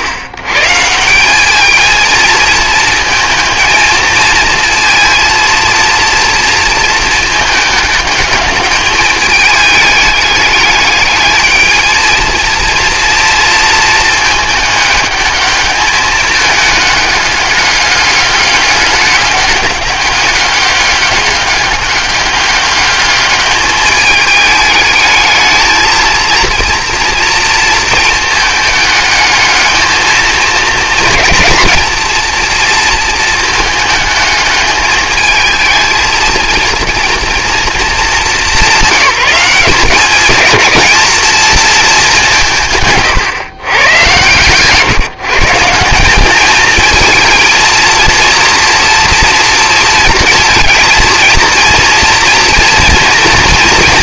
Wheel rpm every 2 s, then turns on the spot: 130, 220, 220, 220, 210, 210, 230, 210, 210, 210, 200, 200, 220, 230, 220, 220, 230, 210, 230, 200, 210, 180, 140, 220, 230, 230, 240.
none